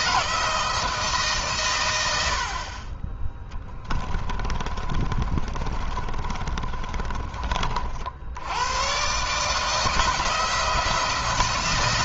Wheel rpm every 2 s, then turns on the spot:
160, 30, 50, 30, 120, 170.
4-8